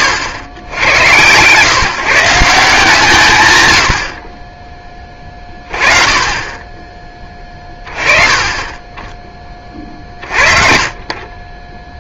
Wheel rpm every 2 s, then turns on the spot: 100, 160, 20, 20, 20, 50.
10-12